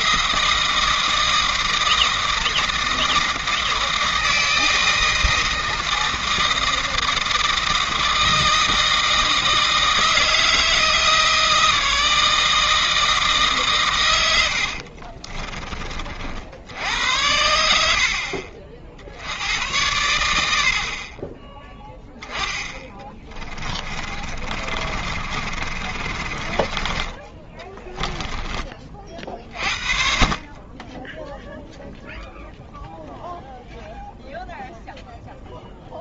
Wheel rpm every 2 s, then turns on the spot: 160, 160, 160, 160, 160, 160, 160, 70, 70, 60, 60, 20, 40, 30, 30, 30, 0, 0.
14-16 22-28